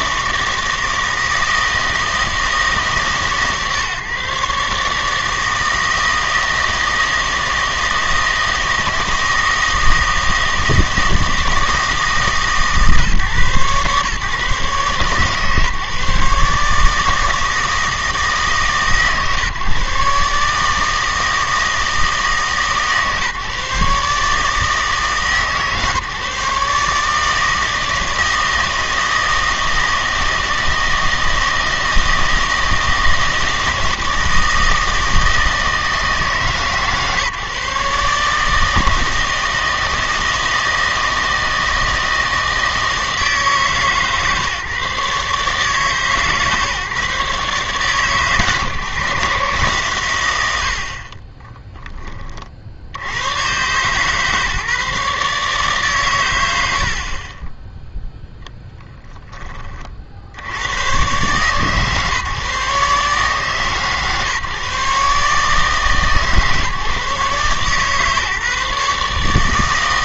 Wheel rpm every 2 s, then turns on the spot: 160, 160, 150, 160, 160, 160, 140, 140, 150, 150, 150, 150, 150, 150, 160, 160, 160, 160, 140, 150, 160, 160, 140, 150, 150, 90, 50, 150, 80, 10, 90, 140, 140, 150, 150.
58-60